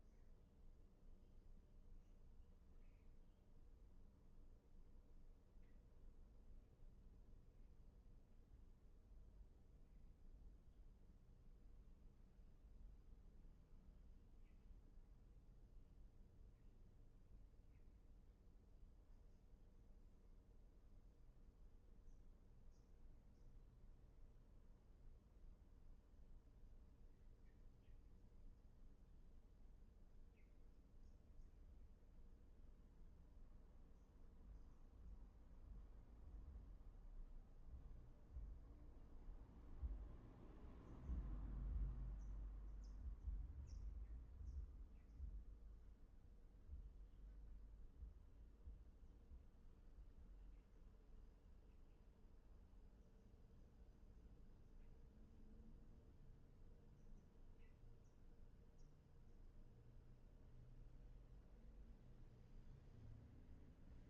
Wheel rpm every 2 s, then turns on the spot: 0, 0, 0, 0, 0, 0, 0, 0, 0, 0, 0, 0, 0, 0, 0, 0, 0, 0, 0, 0, 0, 0, 0, 0, 0, 0, 0, 0, 0, 0, 0, 0.
none